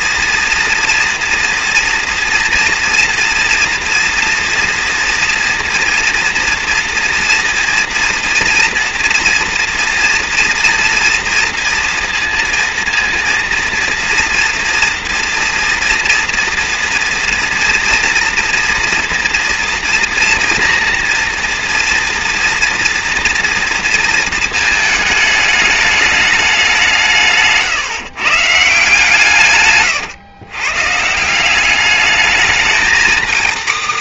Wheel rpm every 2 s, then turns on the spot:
240, 240, 240, 230, 230, 230, 230, 240, 230, 230, 230, 230, 220, 190, 150, 130, 220.
none